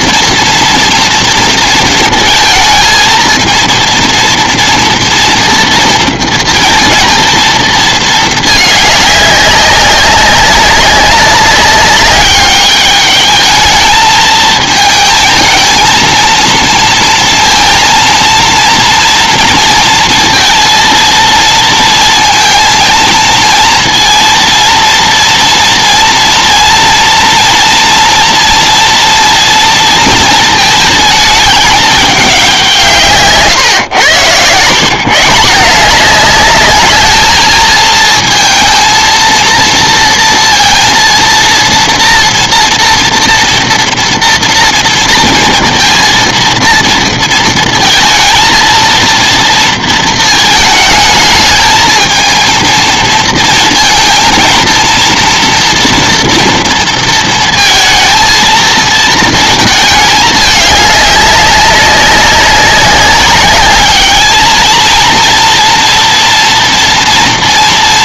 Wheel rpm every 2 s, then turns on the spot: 240, 220, 230, 230, 220, 190, 200, 220, 230, 230, 230, 230, 230, 230, 230, 230, 210, 110, 190, 220, 230, 230, 230, 230, 230, 230, 220, 230, 240, 230, 210, 190, 210, 230.
none